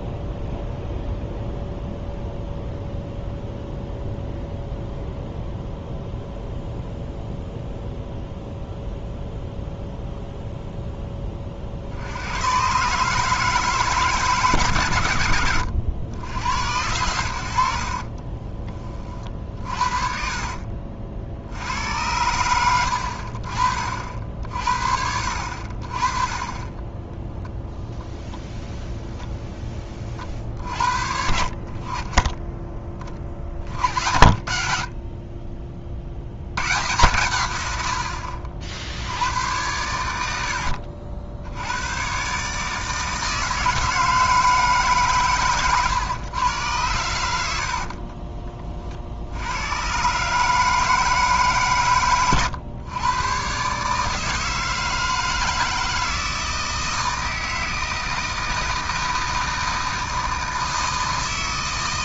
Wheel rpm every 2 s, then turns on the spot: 0, 0, 0, 0, 0, 0, 120, 130, 80, 20, 50, 90, 60, 20, 0, 50, 20, 50, 100, 70, 70, 150, 160, 110, 50, 160, 120, 160, 160, 160, 160.
20-24 26-28